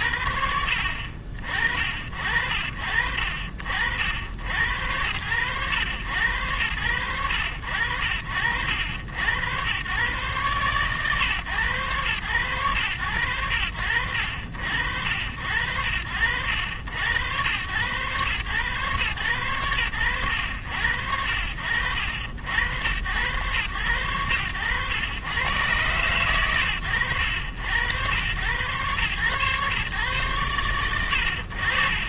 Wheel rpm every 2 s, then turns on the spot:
60, 60, 90, 70, 90, 120, 60, 60, 90, 110, 60, 100, 100, 80, 120, 50.
none